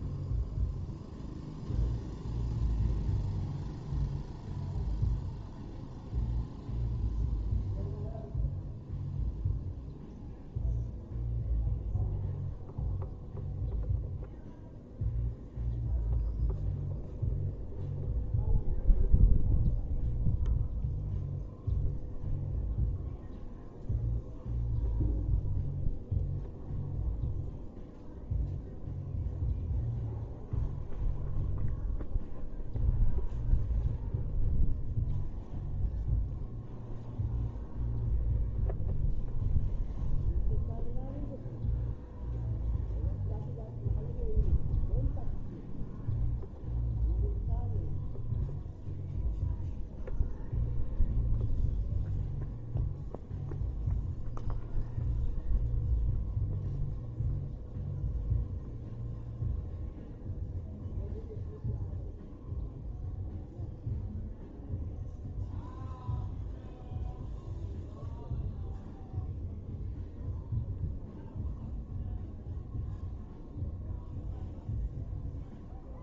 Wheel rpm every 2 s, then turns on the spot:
0, 0, 0, 0, 0, 0, 0, 0, 0, 0, 0, 0, 0, 0, 0, 0, 0, 0, 0, 0, 0, 0, 0, 0, 0, 0, 0, 0, 0, 0, 0, 0, 0, 0, 0, 0, 0, 0.
none